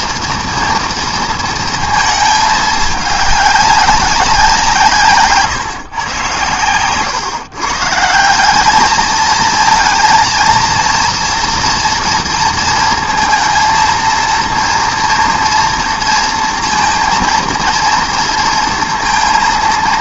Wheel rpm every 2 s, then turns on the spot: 230, 210, 170, 110, 210, 230, 230, 230, 230, 230.
none